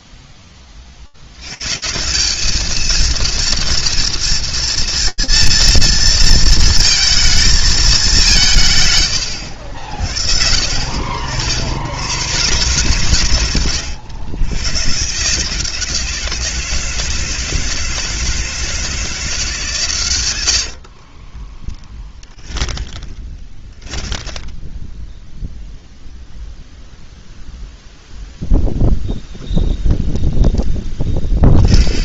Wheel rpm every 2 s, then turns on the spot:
40, 220, 230, 230, 140, 60, 160, 130, 160, 160, 60, 10, 10, 0, 0, 20.
20-24 30-32